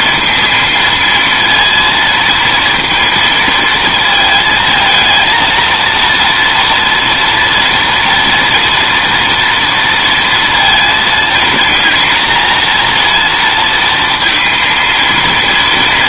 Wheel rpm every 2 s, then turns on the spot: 230, 230, 220, 230, 230, 230, 230, 230.
none